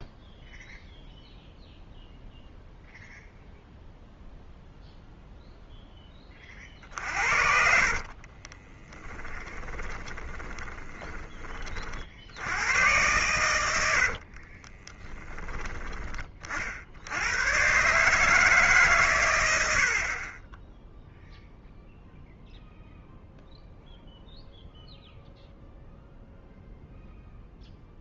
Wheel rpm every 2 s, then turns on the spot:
0, 0, 0, 40, 20, 10, 100, 30, 50, 140, 10, 0, 0, 0.
6-12 14-16